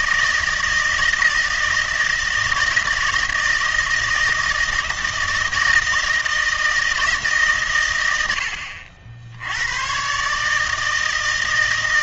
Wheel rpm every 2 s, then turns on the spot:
160, 170, 160, 160, 80, 150.
none